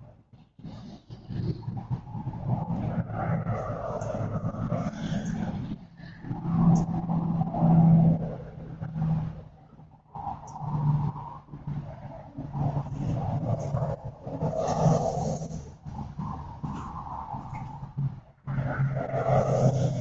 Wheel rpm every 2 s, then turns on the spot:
0, 0, 0, 0, 0, 0, 0, 0, 0, 0.
none